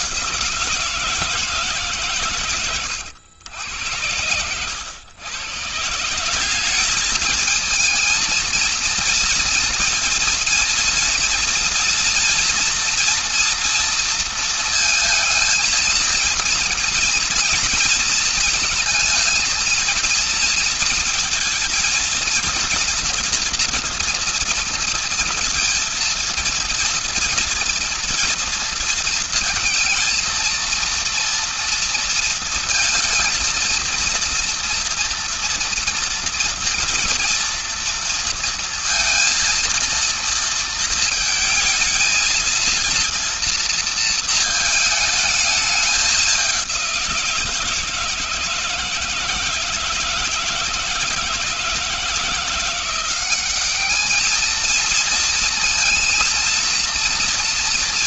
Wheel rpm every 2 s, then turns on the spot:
160, 100, 130, 220, 230, 230, 230, 230, 230, 230, 230, 240, 230, 230, 230, 230, 230, 230, 230, 230, 230, 230, 210, 170, 160, 160, 200, 230, 230.
none